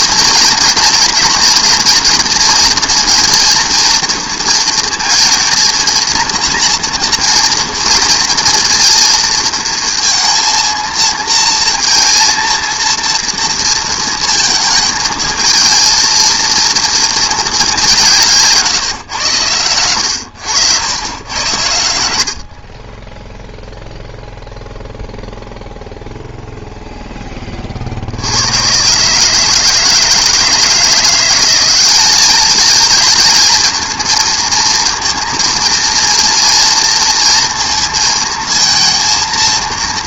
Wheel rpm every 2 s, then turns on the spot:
230, 230, 230, 230, 230, 230, 230, 220, 230, 140, 90, 50, 0, 0, 100, 160, 210, 230, 230, 220.
none